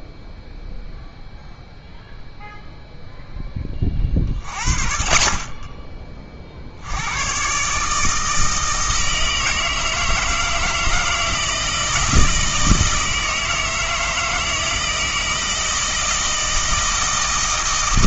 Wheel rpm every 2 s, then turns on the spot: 0, 0, 40, 60, 160, 160, 160, 160, 160.
none